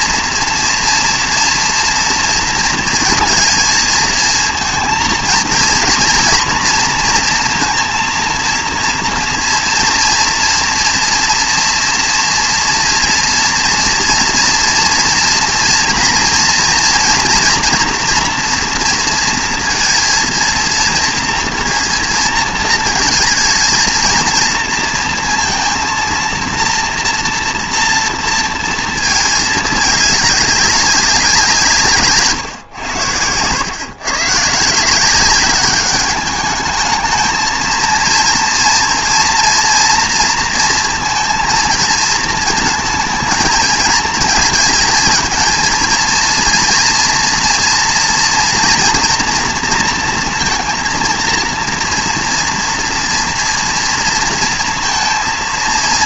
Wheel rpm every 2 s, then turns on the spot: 240, 230, 230, 230, 230, 230, 230, 230, 230, 230, 230, 230, 230, 230, 230, 200, 120, 150, 210, 230, 230, 230, 230, 230, 240, 230, 230, 230.
none